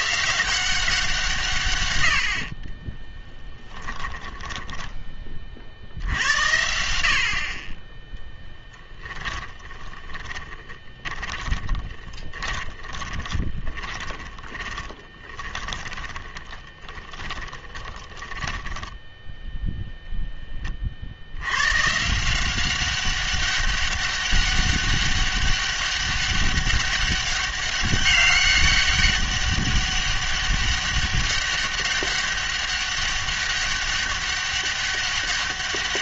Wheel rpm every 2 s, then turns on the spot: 180, 20, 10, 80, 10, 20, 30, 20, 30, 10, 30, 190, 200, 200, 200, 200, 200, 200.
2-6 10-20